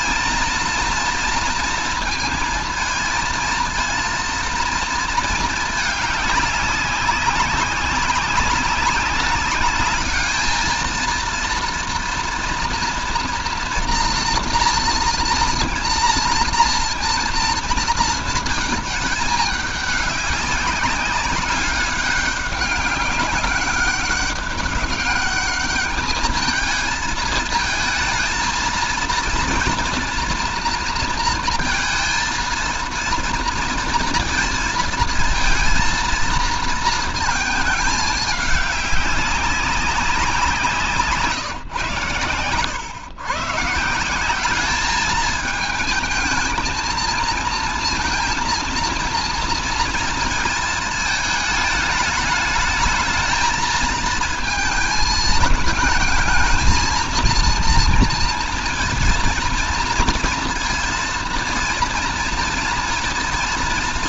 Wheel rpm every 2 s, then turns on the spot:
230, 230, 230, 200, 190, 220, 230, 230, 230, 220, 190, 200, 200, 220, 230, 230, 230, 230, 220, 200, 160, 130, 210, 230, 230, 220, 220, 220, 220, 230, 230, 230.
none